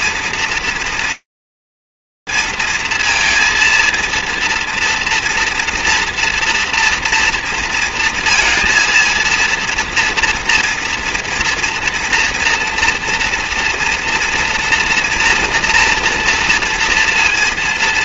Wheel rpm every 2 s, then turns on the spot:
230, 230, 240, 230, 230, 230, 240, 240, 230.
none